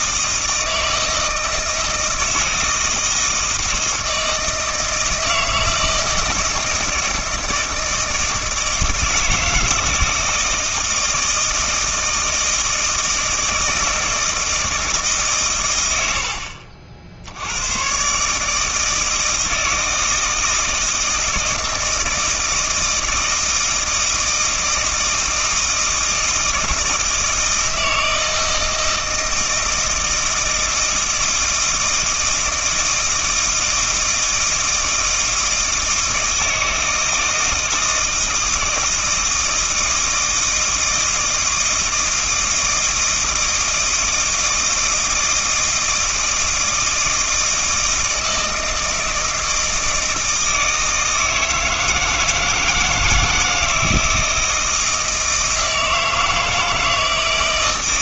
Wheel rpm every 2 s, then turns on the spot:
160, 160, 160, 160, 160, 160, 160, 160, 60, 160, 160, 160, 160, 160, 160, 160, 160, 160, 160, 160, 160, 160, 160, 160, 160, 160, 160, 160, 160.
none